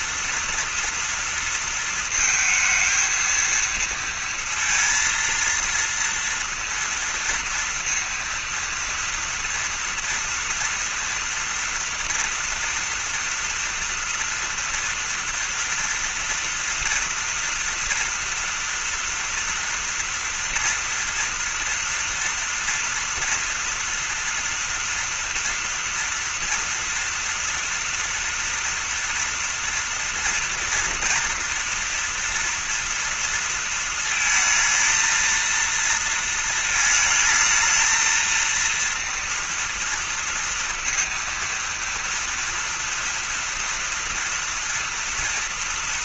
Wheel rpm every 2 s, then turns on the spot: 230, 230, 230, 230, 230, 230, 230, 230, 230, 230, 230, 230, 230, 230, 230, 230, 240, 220, 230, 230, 230, 230, 230.
none